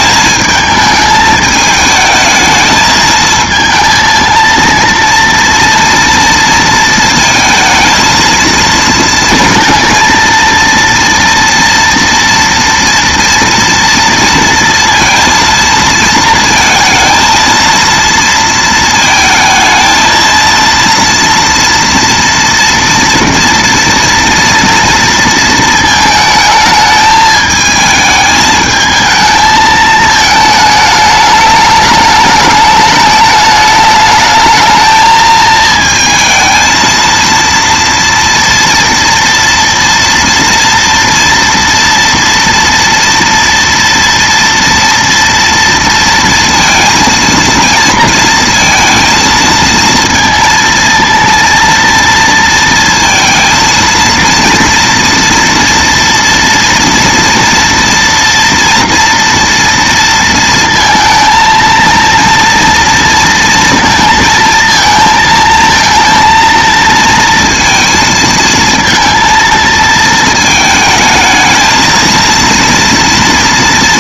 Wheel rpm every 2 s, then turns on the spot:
220, 220, 230, 230, 230, 230, 230, 230, 230, 230, 230, 230, 230, 220, 220, 220, 210, 220, 220, 230, 230, 230, 230, 230, 230, 230, 230, 230, 230, 230, 230, 230, 230, 230, 230, 220, 230.
none